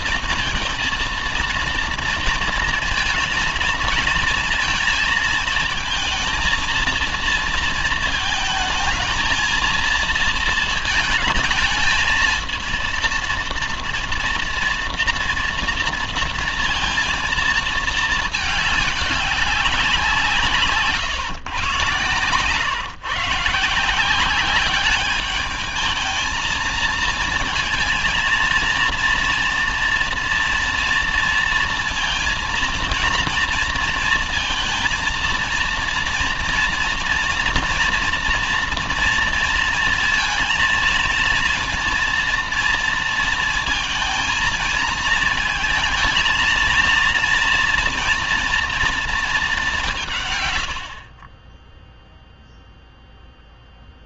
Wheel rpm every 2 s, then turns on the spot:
230, 230, 230, 230, 220, 230, 230, 230, 230, 210, 150, 130, 200, 230, 230, 240, 230, 230, 230, 230, 220, 230, 230, 230, 230, 110, 0.
none